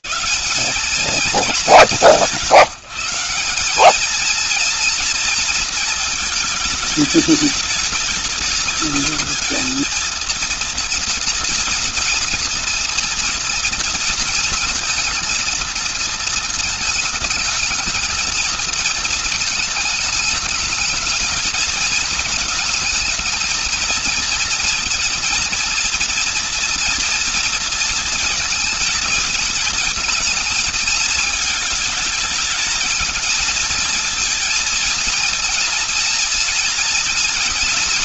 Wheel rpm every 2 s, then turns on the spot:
160, 160, 220, 220, 210, 230, 230, 230, 220, 220, 210, 220, 220, 230, 230, 230, 220, 220, 230.
none